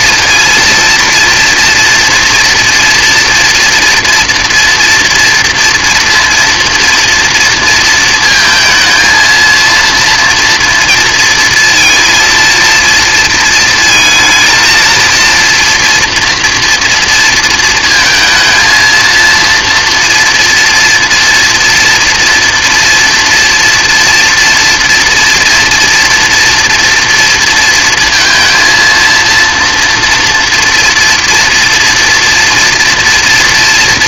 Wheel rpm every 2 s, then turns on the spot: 230, 230, 230, 230, 230, 230, 230, 220, 230, 230, 230, 230, 230, 230, 230, 230, 230.
none